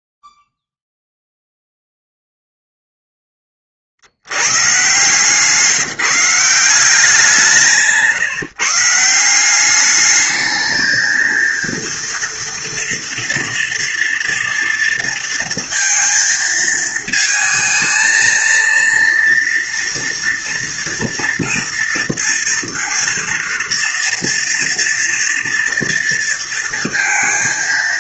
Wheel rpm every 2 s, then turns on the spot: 0, 0, 110, 180, 150, 220, 230, 230, 220, 230, 230, 230, 230, 230.
none